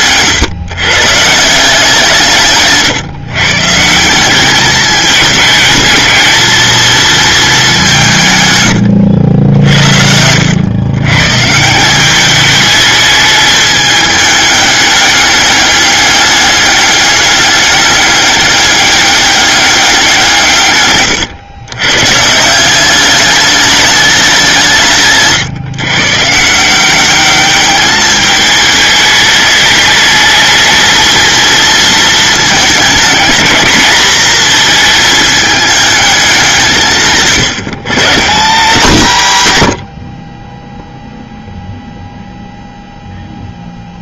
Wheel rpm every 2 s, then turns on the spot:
140, 140, 210, 220, 100, 110, 210, 210, 200, 200, 140, 180, 170, 180, 210, 220, 220, 230, 170, 170, 0, 0.
20-22